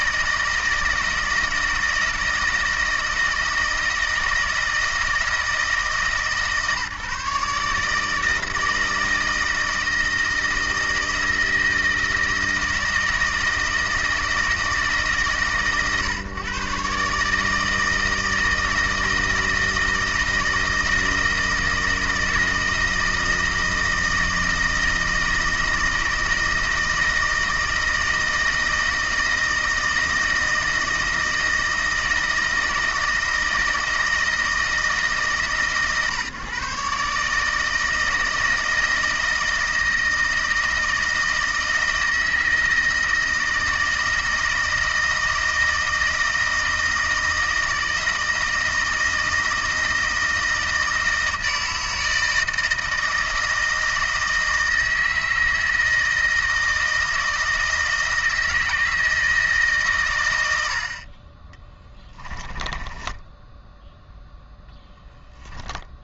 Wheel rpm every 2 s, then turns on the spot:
160, 160, 160, 150, 160, 160, 160, 140, 140, 160, 160, 160, 160, 160, 160, 160, 160, 150, 140, 160, 160, 160, 160, 160, 170, 160, 160, 160, 160, 160, 60, 10, 10.
62-66